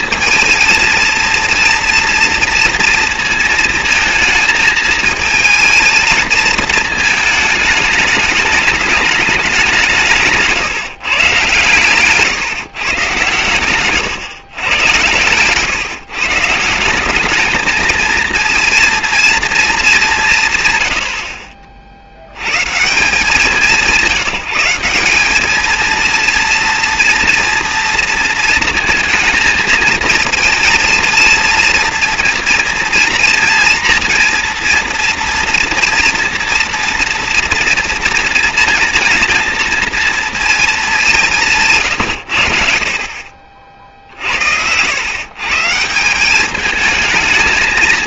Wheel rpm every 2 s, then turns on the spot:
230, 230, 220, 220, 220, 160, 150, 110, 170, 230, 130, 90, 180, 230, 230, 230, 230, 230, 230, 220, 220, 70, 80, 200.
none